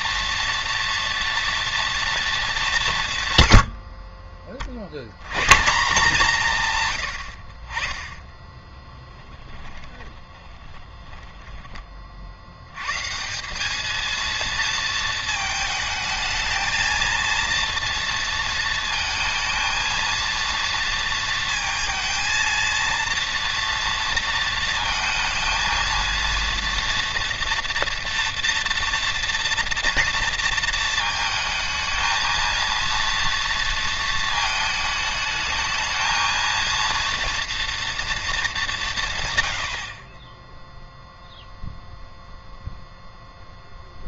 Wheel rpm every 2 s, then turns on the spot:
230, 160, 110, 90, 20, 10, 160, 230, 230, 220, 230, 230, 230, 240, 240, 230, 230, 220, 230, 130, 0, 0.
8-12